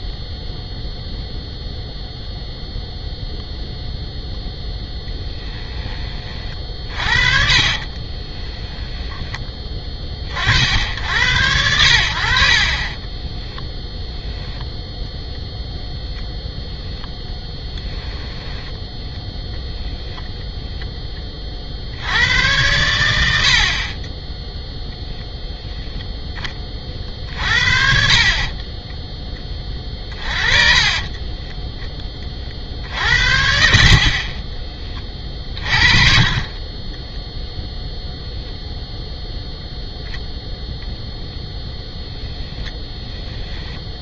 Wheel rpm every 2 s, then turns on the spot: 0, 0, 10, 40, 10, 60, 40, 0, 0, 10, 10, 100, 0, 30, 20, 30, 50, 20, 20, 0, 0, 10.
6-10 12-14 30-32 34-38 42-44